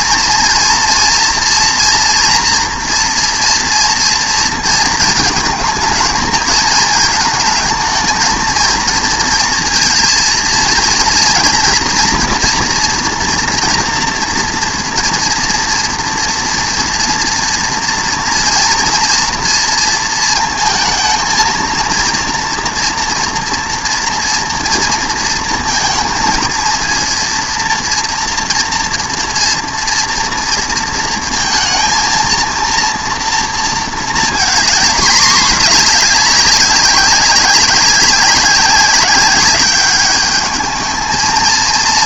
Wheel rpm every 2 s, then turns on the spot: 240, 230, 230, 220, 230, 230, 230, 230, 240, 230, 220, 240, 230, 230, 230, 230, 230, 220, 200, 190, 210.
none